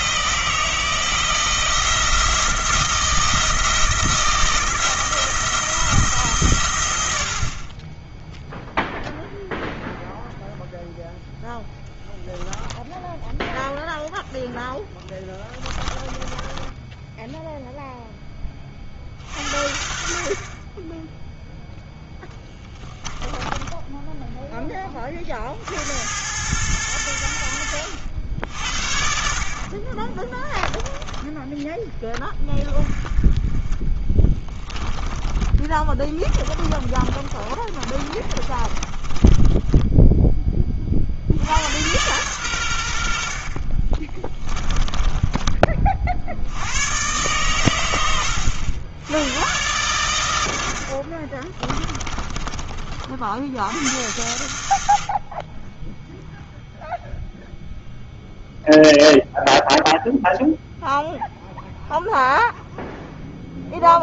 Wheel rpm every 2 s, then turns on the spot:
160, 170, 170, 110, 0, 0, 10, 10, 10, 30, 20, 20, 20, 100, 70, 10, 20, 10, 30, 30, 30, 90, 20, 100, 80, 80, 40, 110, 0, 0, 0, 0.
16-18 22-24 30-32 34-40 44-46 50-52